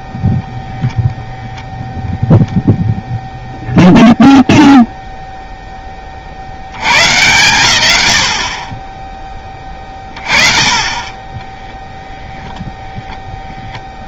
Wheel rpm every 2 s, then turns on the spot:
0, 0, 0, 110, 20, 40, 0.
none